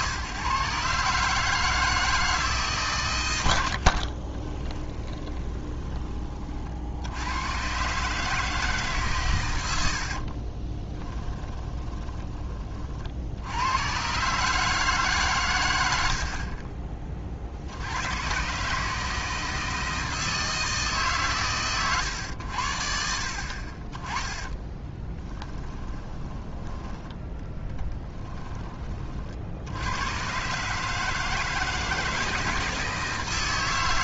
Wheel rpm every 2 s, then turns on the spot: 130, 140, 20, 60, 150, 20, 40, 150, 30, 140, 160, 70, 10, 10, 20, 140, 160.
4-6 10-12 24-26